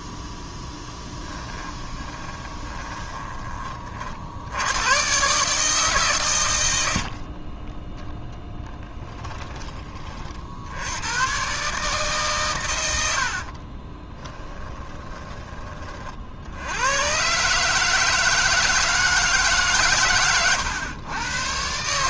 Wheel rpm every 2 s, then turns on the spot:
10, 20, 80, 100, 10, 70, 110, 20, 80, 160, 100.
0-4 8-10 14-16